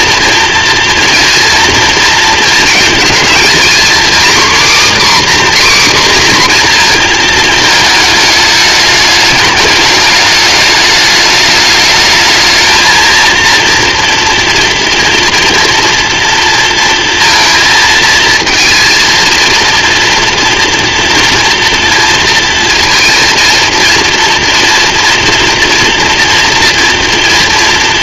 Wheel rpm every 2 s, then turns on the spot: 230, 230, 270, 240, 210, 210, 220, 230, 230, 230, 230, 230, 230, 230.
none